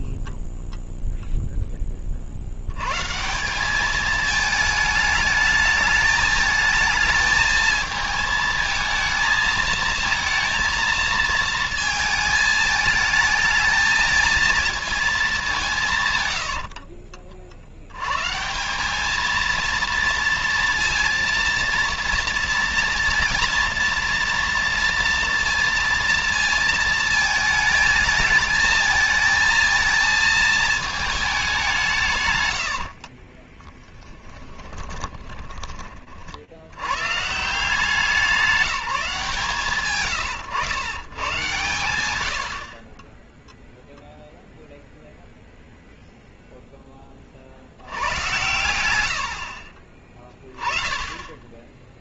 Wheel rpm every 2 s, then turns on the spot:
10, 190, 210, 220, 220, 220, 220, 190, 70, 230, 230, 240, 230, 220, 220, 180, 10, 50, 180, 130, 100, 0, 0, 100, 20, 0.
32-34